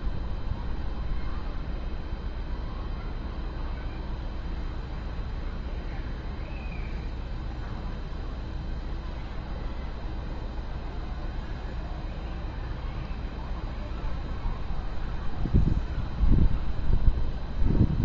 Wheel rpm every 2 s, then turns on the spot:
0, 0, 0, 0, 0, 0, 0, 0, 0.
none